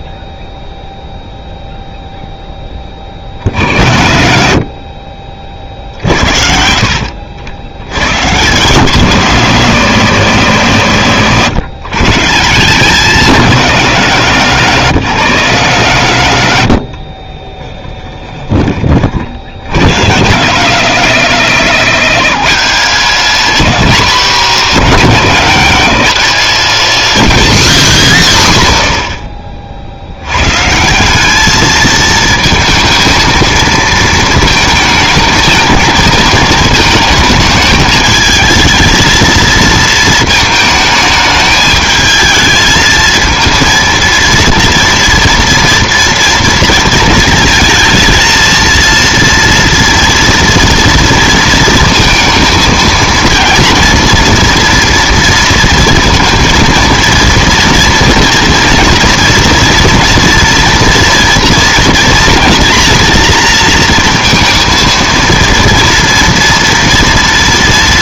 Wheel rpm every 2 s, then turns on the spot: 0, 10, 60, 60, 140, 140, 170, 170, 80, 20, 150, 180, 200, 180, 10, 140, 220, 220, 220, 220, 220, 220, 240, 230, 230, 230, 220, 230, 230, 230, 240, 230, 230, 230.
16-18